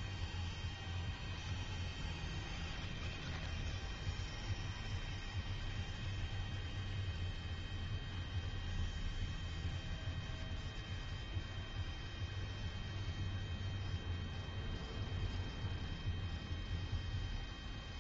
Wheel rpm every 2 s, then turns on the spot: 0, 0, 0, 0, 0, 0, 0, 0, 0.
none